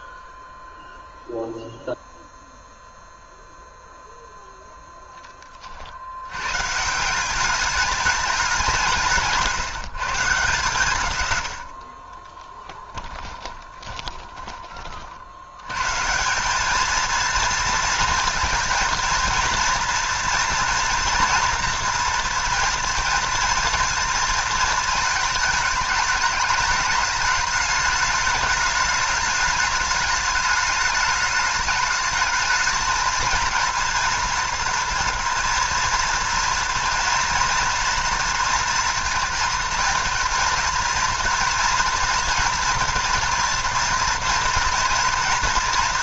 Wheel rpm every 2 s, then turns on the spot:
0, 0, 0, 140, 190, 150, 10, 40, 200, 230, 230, 230, 220, 210, 210, 210, 220, 230, 230, 230, 220, 230, 230.
12-14